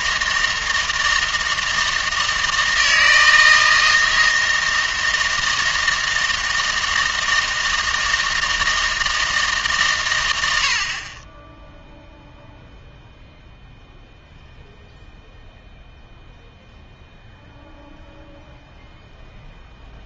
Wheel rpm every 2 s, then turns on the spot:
160, 160, 160, 160, 160, 70, 0, 0, 0, 0.
none